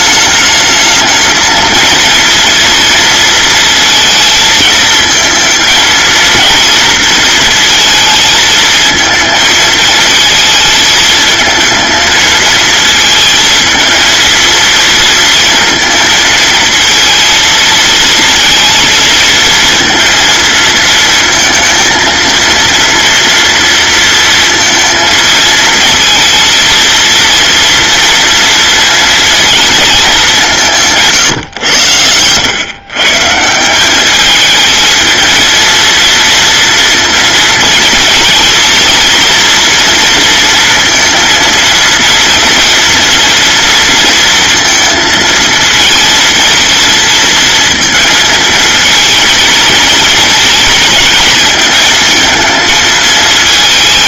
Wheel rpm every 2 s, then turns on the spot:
210, 230, 220, 230, 220, 220, 220, 230, 230, 230, 230, 230, 230, 230, 230, 180, 120, 220, 230, 220, 230, 230, 230, 220, 230, 220, 220.
none